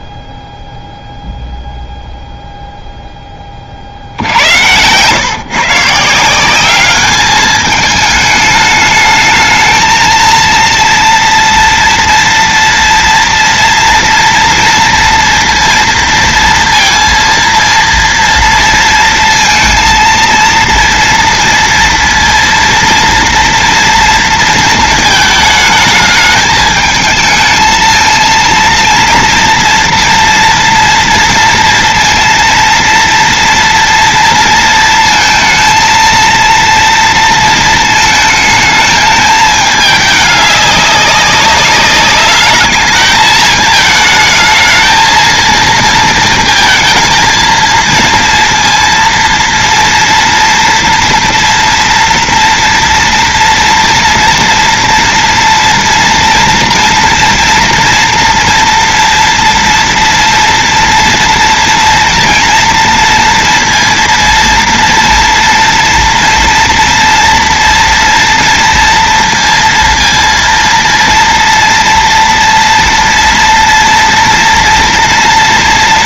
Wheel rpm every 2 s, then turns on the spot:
0, 0, 90, 180, 220, 230, 230, 230, 230, 230, 230, 230, 230, 210, 230, 230, 230, 230, 230, 220, 210, 200, 220, 220, 230, 230, 230, 230, 230, 230, 230, 230, 230, 230, 230, 230, 230, 230.
none